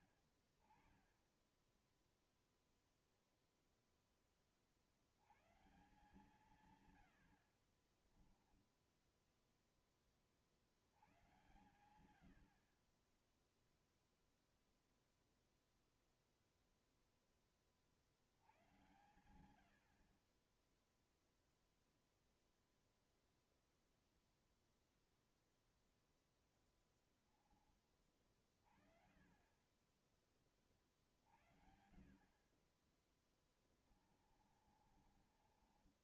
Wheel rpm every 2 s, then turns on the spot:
110, 10, 10, 150, 20, 20, 110, 0, 0, 60, 50, 0, 0, 0, 20, 20, 50, 30.
8-10 34-36